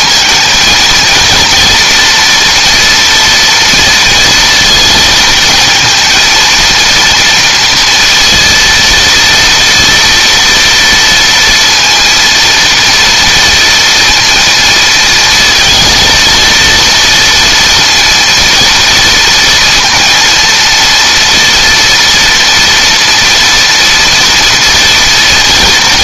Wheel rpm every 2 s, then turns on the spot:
230, 230, 230, 230, 230, 230, 230, 230, 230, 230, 230, 240, 230.
none